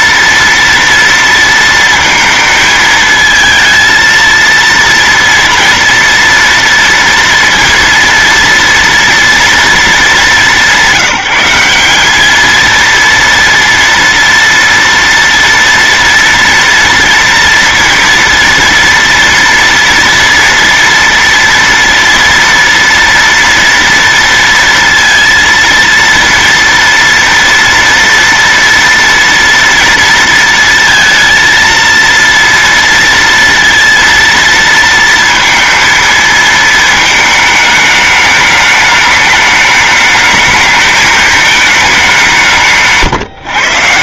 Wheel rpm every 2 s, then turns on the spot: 230, 220, 230, 240, 230, 190, 220, 230, 230, 230, 240, 230, 230, 230, 230, 230, 230, 230, 220, 210, 220, 170.
42-44